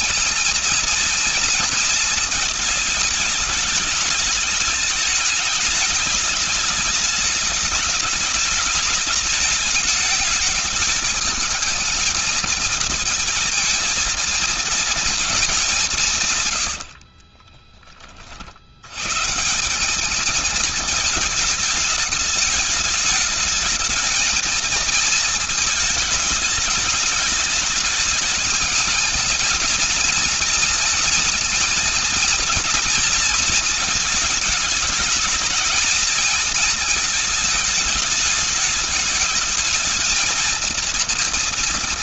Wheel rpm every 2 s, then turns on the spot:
230, 210, 210, 210, 210, 220, 230, 220, 50, 100, 220, 210, 220, 210, 220, 220, 230, 220, 220, 220, 230.
16-18